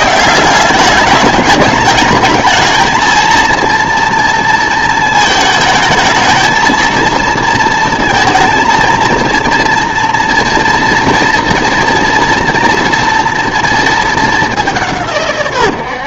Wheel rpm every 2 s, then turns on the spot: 200, 220, 230, 220, 230, 240, 230, 180.
none